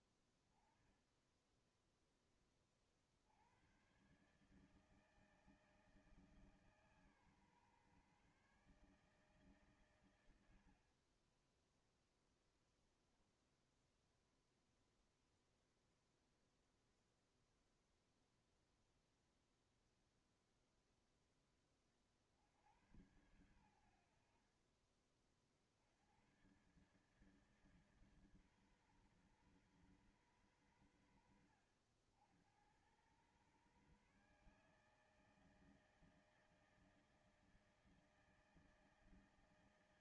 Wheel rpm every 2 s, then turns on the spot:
10, 20, 130, 160, 140, 100, 0, 0, 0, 0, 0, 60, 70, 110, 140, 120, 90, 150, 160, 160.
none